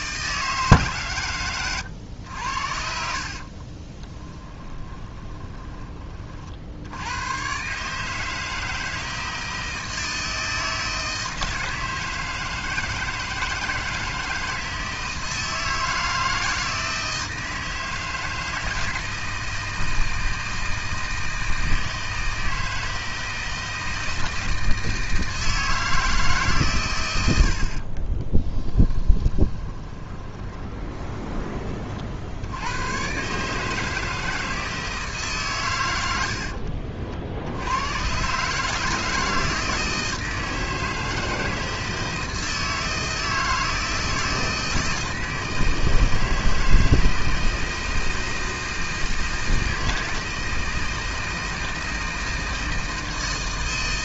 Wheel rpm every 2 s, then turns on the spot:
140, 60, 20, 80, 160, 160, 160, 160, 160, 160, 160, 160, 160, 120, 10, 20, 100, 160, 70, 150, 160, 160, 160, 160, 160, 160, 160.
4-6 28-32